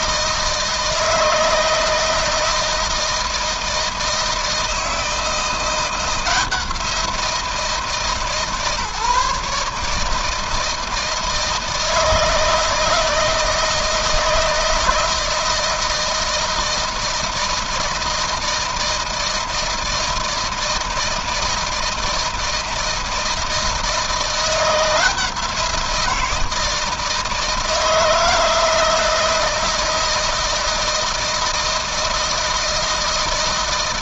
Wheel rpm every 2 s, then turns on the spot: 160, 160, 160, 170, 150, 160, 160, 160, 160, 160, 160, 160, 170, 160, 160, 160, 160.
none